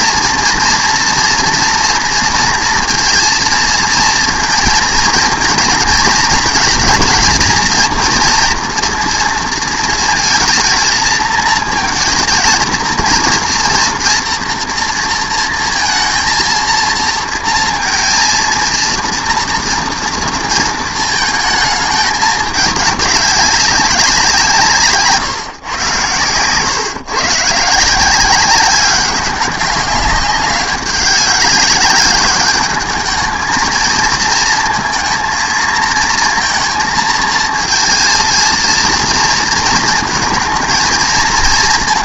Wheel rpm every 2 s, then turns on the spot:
230, 230, 230, 220, 230, 220, 230, 230, 230, 230, 230, 210, 170, 130, 190, 200, 210, 230, 230, 230, 220.
none